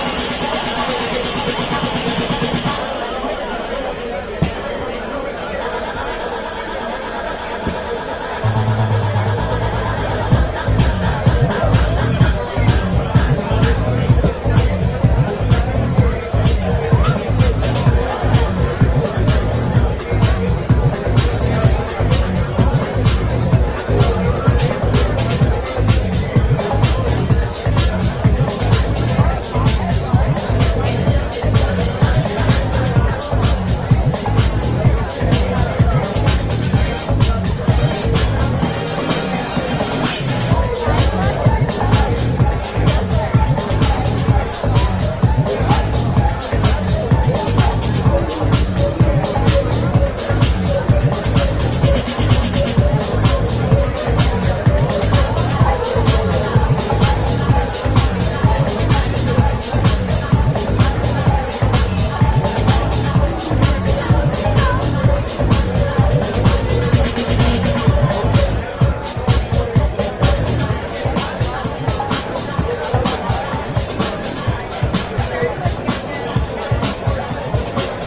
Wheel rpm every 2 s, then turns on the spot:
0, 0, 0, 0, 0, 0, 0, 0, 0, 0, 0, 0, 0, 0, 0, 0, 0, 0, 0, 0, 0, 0, 0, 0, 0, 0, 0, 0, 0, 0, 0, 0, 0, 0, 0, 0, 0, 0, 0.
none